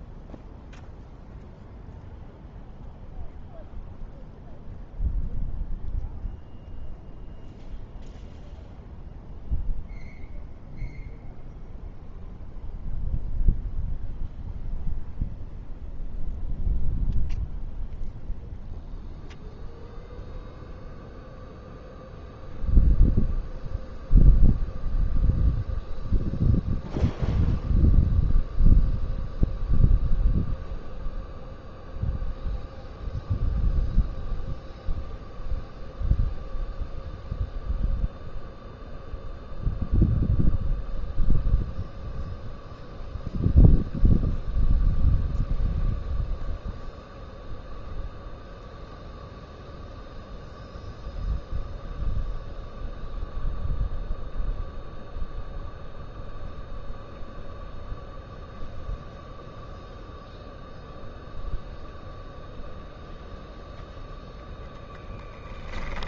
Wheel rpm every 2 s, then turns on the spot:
0, 0, 0, 0, 0, 0, 0, 0, 0, 0, 0, 0, 0, 0, 0, 0, 0, 0, 0, 0, 0, 0, 0, 0, 0, 0, 0, 0, 0, 0, 0, 0, 10.
64-66